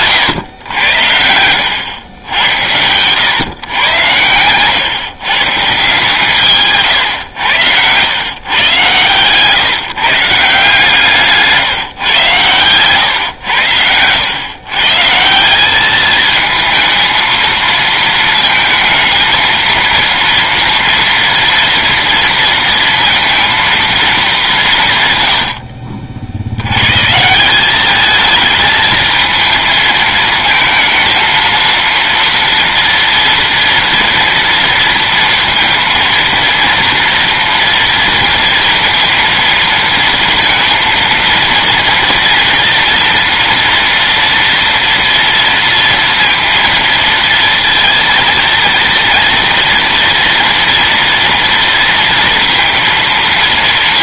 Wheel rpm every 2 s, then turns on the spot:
90, 100, 120, 130, 120, 160, 130, 150, 220, 220, 230, 230, 150, 100, 220, 220, 230, 230, 230, 230, 230, 230, 230, 230, 230, 230, 230.
6-8